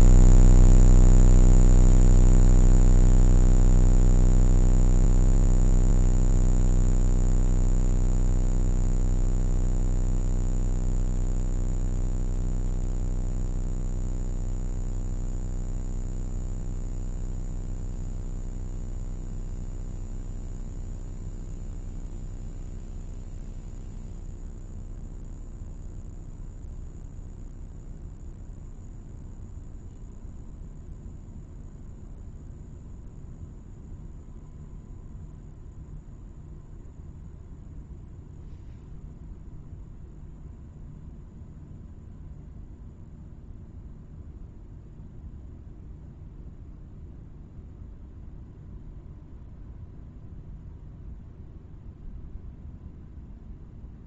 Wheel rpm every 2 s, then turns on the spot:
0, 0, 0, 0, 0, 0, 0, 0, 0, 0, 0, 0, 0, 0, 0, 0, 0, 0, 0, 0, 0, 0, 0, 0, 0, 0, 0.
none